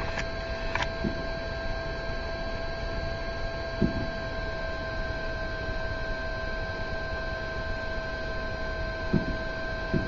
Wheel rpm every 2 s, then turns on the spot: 0, 0, 0, 0, 0.
none